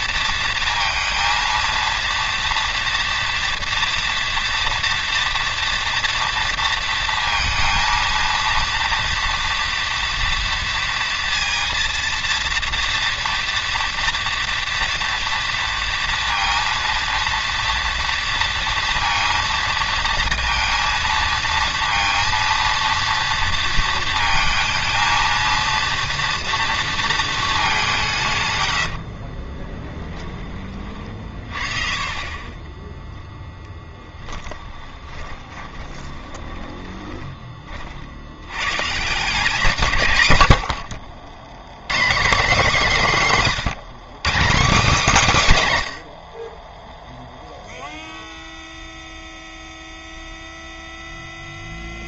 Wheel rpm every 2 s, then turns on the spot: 230, 240, 240, 230, 230, 230, 230, 230, 230, 230, 230, 230, 220, 230, 100, 30, 10, 10, 20, 130, 70, 230, 230, 20, 0, 0.
32-38